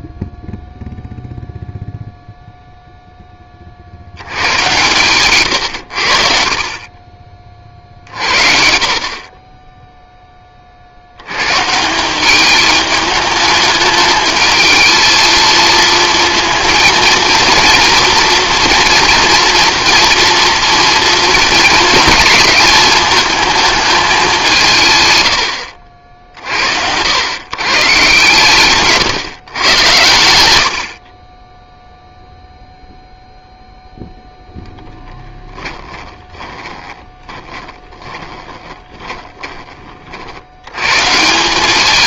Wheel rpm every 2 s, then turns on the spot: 0, 0, 110, 40, 60, 40, 210, 220, 230, 240, 230, 220, 150, 90, 150, 80, 0, 0, 10, 20, 100.
36-40